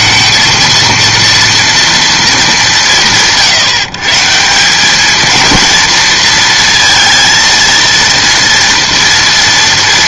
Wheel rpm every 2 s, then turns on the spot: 230, 200, 180, 230, 240.
none